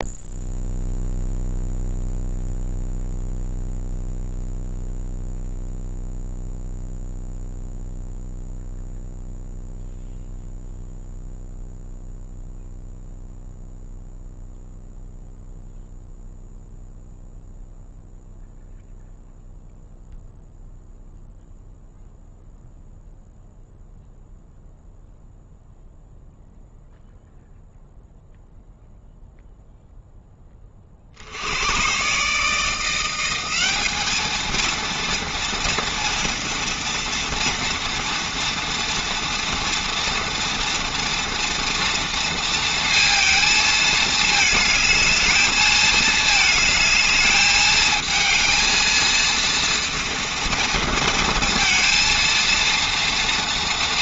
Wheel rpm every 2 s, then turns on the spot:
0, 0, 0, 0, 0, 0, 0, 0, 0, 0, 0, 0, 0, 0, 0, 10, 150, 220, 240, 230, 230, 230, 220, 220, 220, 230, 230.
none